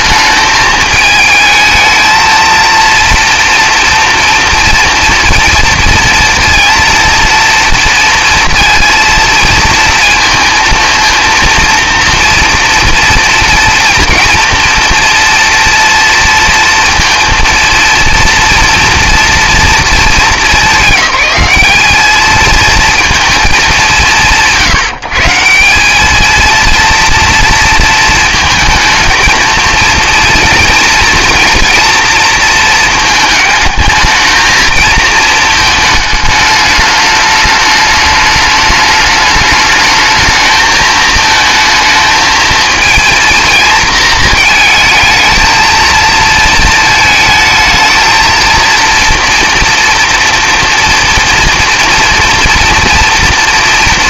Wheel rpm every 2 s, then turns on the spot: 220, 230, 230, 230, 230, 230, 230, 230, 230, 230, 200, 220, 160, 230, 230, 230, 230, 220, 210, 210, 220, 220, 220, 220, 230, 230, 230.
none